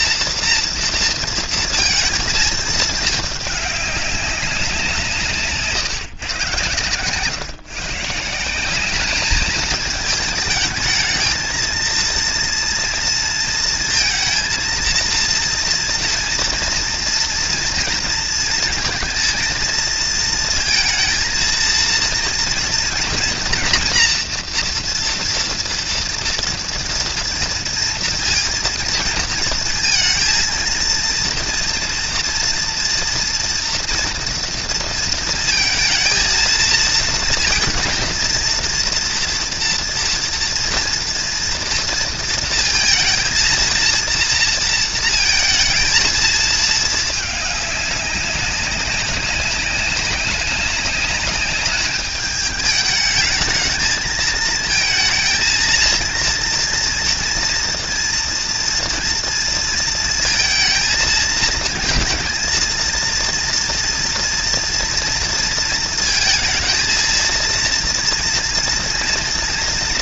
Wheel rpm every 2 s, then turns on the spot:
230, 220, 180, 120, 200, 220, 230, 230, 230, 230, 230, 230, 230, 230, 230, 230, 240, 230, 230, 230, 230, 230, 230, 220, 190, 200, 210, 220, 230, 230, 230, 230, 230, 230, 230.
none